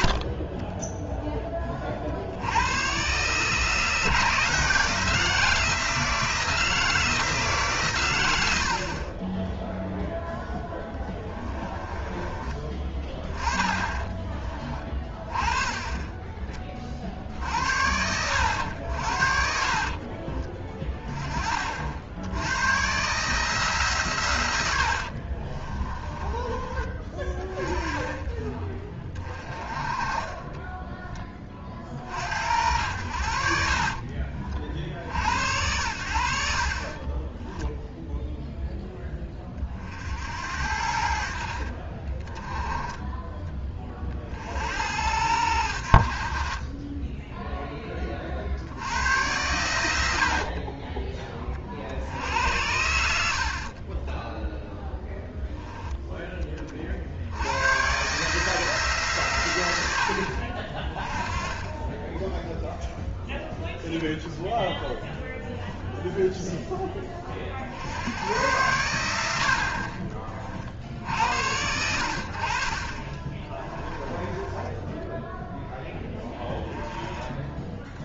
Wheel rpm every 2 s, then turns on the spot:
10, 110, 160, 160, 60, 10, 20, 20, 40, 80, 20, 120, 70, 20, 30, 10, 80, 50, 30, 10, 70, 20, 70, 20, 80, 30, 70, 0, 40, 150, 50, 0, 10, 20, 90, 50, 40, 10, 20.
10-14 24-26 30-32 64-66 72-76